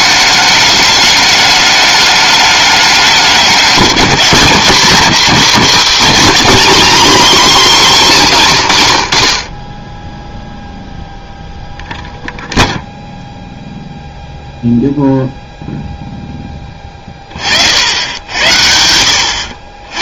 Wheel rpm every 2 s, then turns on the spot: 210, 200, 210, 280, 120, 0, 0, 0, 10, 80.
none